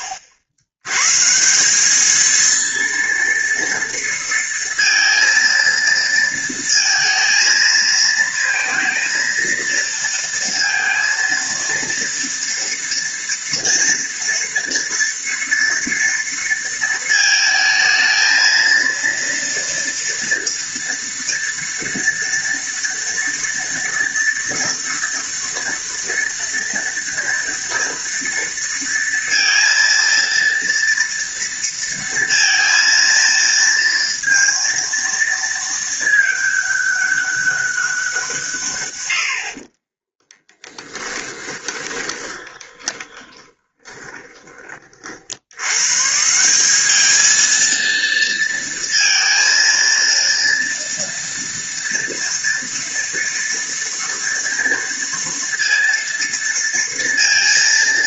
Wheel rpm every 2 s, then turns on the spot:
80, 230, 230, 230, 230, 230, 230, 230, 220, 230, 230, 230, 230, 230, 230, 230, 230, 230, 200, 100, 10, 20, 40, 200, 230, 230, 230, 230, 230.
40-44